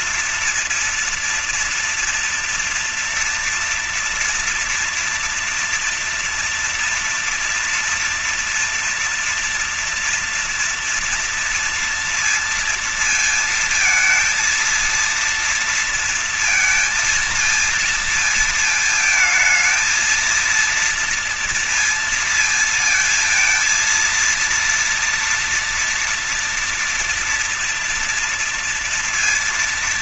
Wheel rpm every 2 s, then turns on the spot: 230, 230, 230, 230, 230, 230, 230, 230, 230, 230, 220, 230, 230, 230, 230.
none